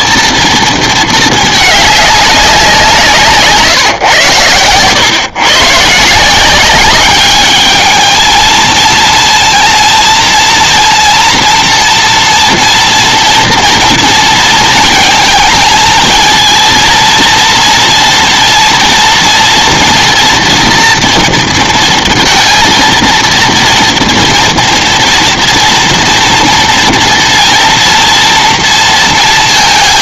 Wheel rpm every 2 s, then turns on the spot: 220, 140, 120, 210, 230, 230, 230, 220, 230, 230, 230, 230, 230, 240, 230.
none